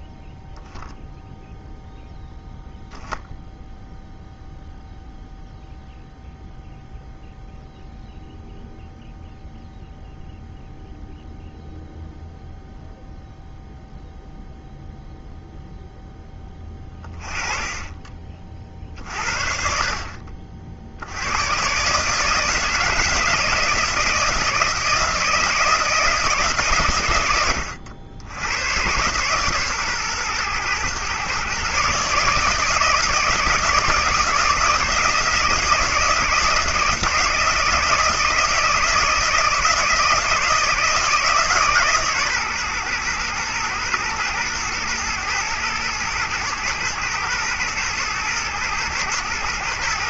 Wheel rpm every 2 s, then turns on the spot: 0, 0, 0, 0, 0, 0, 0, 0, 20, 40, 60, 160, 160, 140, 100, 120, 160, 160, 160, 160, 160, 130, 110, 120, 110.
none